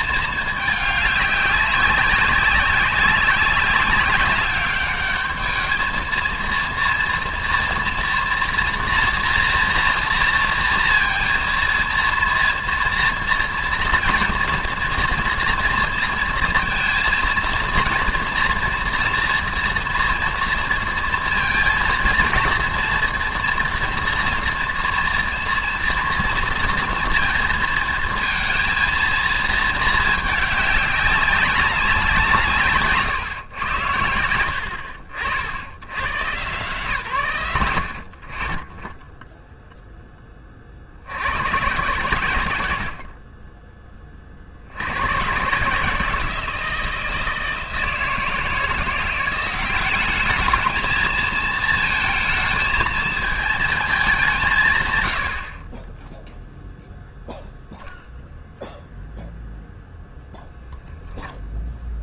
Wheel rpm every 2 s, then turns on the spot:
210, 190, 200, 230, 230, 230, 240, 230, 230, 230, 230, 230, 230, 230, 230, 210, 150, 60, 120, 30, 30, 90, 50, 160, 170, 210, 220, 160, 0, 0, 0.
none